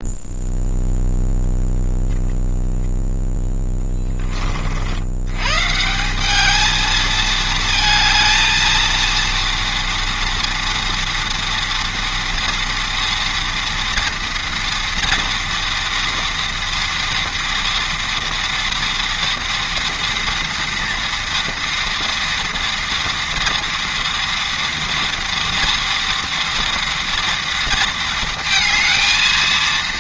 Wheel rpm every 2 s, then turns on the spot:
0, 0, 60, 220, 230, 230, 240, 230, 230, 230, 230, 230, 230, 240, 220.
none